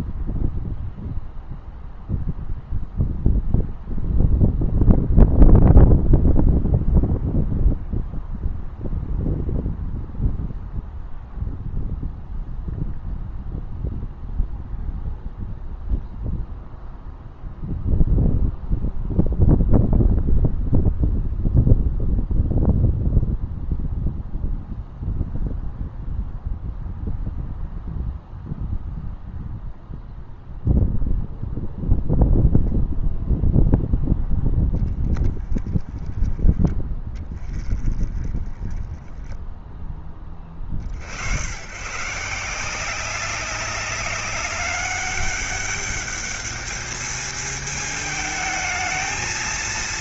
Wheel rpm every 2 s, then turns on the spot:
0, 0, 0, 0, 0, 0, 0, 0, 0, 0, 0, 0, 0, 0, 0, 0, 0, 10, 10, 10, 70, 180, 200, 220, 220.
none